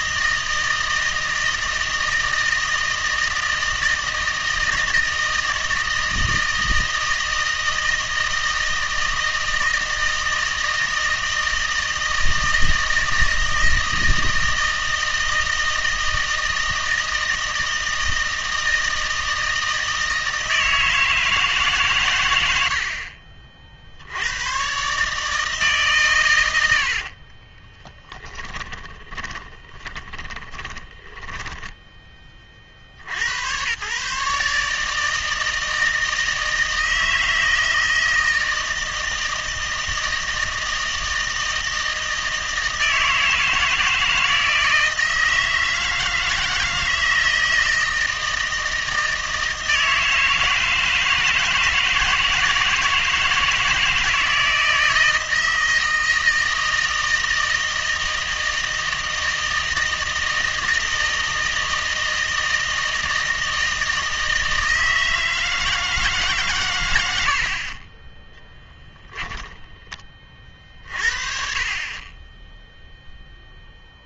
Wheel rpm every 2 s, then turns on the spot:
160, 160, 160, 160, 160, 160, 160, 160, 160, 160, 160, 70, 130, 80, 10, 20, 60, 150, 160, 160, 160, 160, 160, 160, 160, 160, 160, 160, 160, 160, 160, 160, 160, 110, 10, 40, 0.
28-32